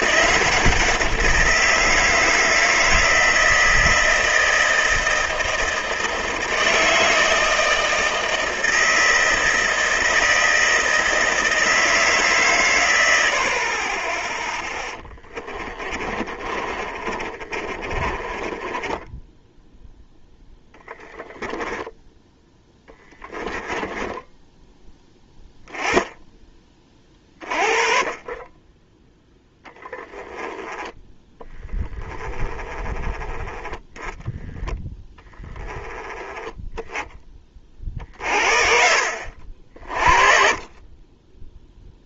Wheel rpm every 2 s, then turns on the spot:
180, 160, 160, 160, 160, 160, 110, 10, 30, 20, 10, 10, 10, 30, 10, 10, 10, 10, 10, 50, 20.
14-24